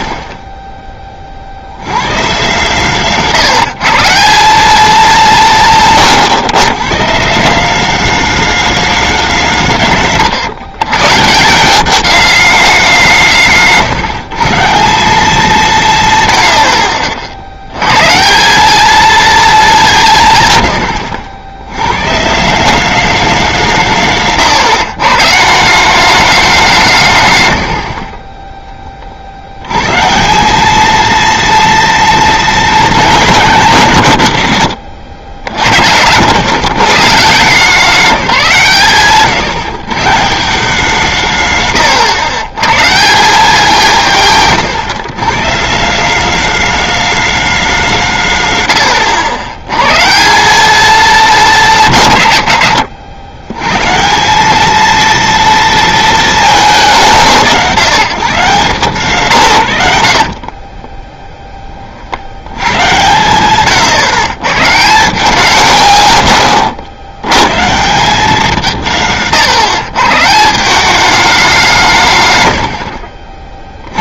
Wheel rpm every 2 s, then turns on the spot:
30, 140, 190, 140, 210, 130, 210, 150, 80, 190, 130, 180, 150, 190, 20, 180, 210, 120, 120, 160, 170, 120, 150, 210, 120, 200, 140, 200, 210, 160, 40, 90, 130, 110, 190, 170, 100.
60-62